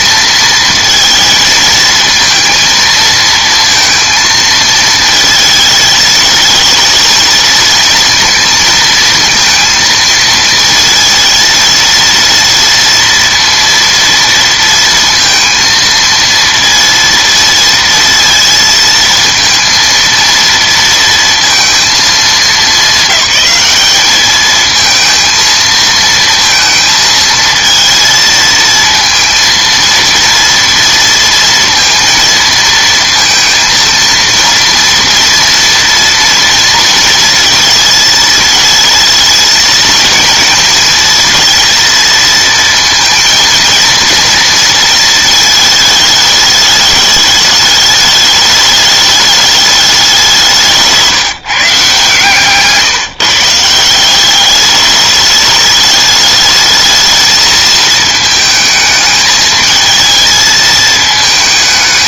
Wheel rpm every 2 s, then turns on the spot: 230, 230, 220, 220, 220, 230, 230, 230, 230, 230, 230, 200, 220, 230, 230, 230, 230, 230, 230, 220, 230, 230, 230, 210, 210, 180, 150, 200, 210, 210, 220.
none